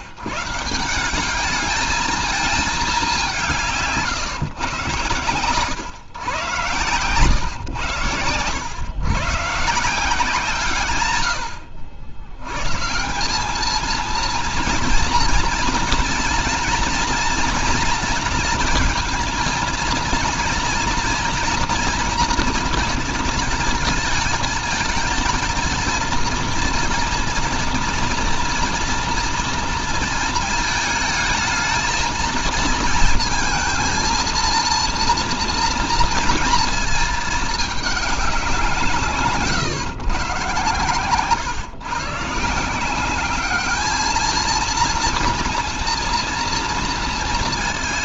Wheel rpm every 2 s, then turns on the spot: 160, 210, 120, 120, 100, 140, 130, 230, 230, 230, 230, 230, 220, 230, 230, 220, 230, 230, 230, 180, 150, 170, 230, 230.
6-8